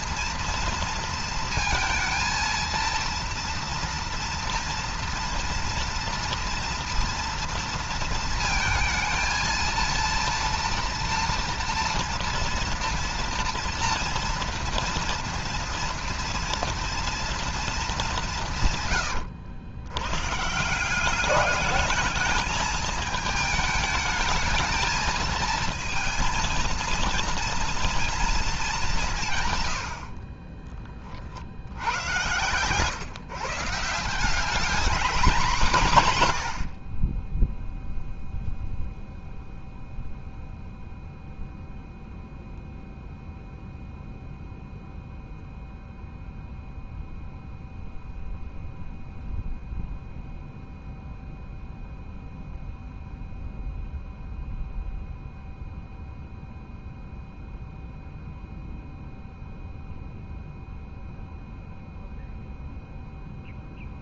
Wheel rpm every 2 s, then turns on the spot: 230, 230, 230, 230, 220, 230, 230, 230, 230, 150, 150, 220, 220, 230, 210, 50, 120, 200, 70, 0, 0, 0, 0, 0, 0, 0, 0, 0, 0, 0, 0, 0.
30-32